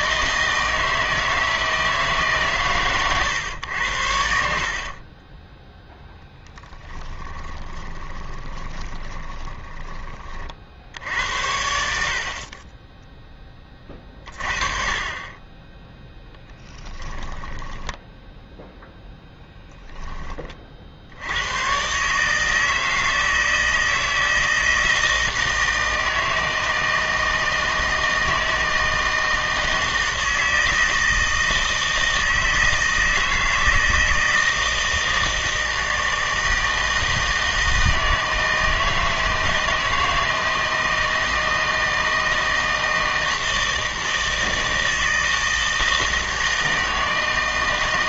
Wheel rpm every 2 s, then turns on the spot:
160, 130, 50, 10, 10, 50, 20, 30, 10, 0, 40, 160, 160, 160, 160, 160, 160, 160, 160, 160, 160, 160, 160, 160.
4-10 16-18